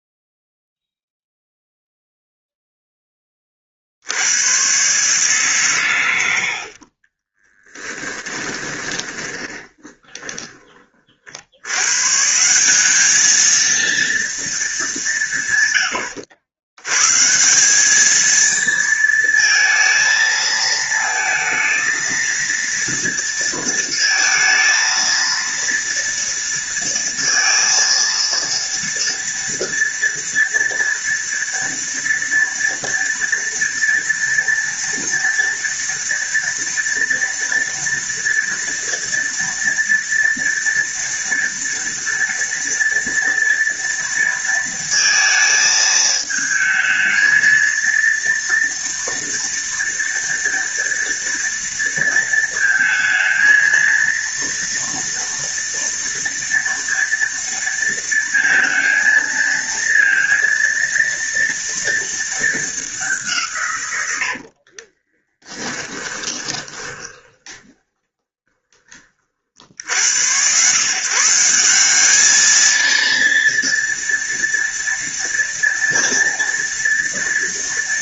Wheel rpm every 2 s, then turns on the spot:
0, 0, 110, 60, 20, 20, 170, 210, 100, 220, 220, 230, 230, 230, 230, 230, 230, 230, 230, 230, 230, 230, 230, 220, 230, 230, 230, 230, 240, 230, 230, 210, 50, 20, 20, 120, 220, 230, 230.
8-10 64-70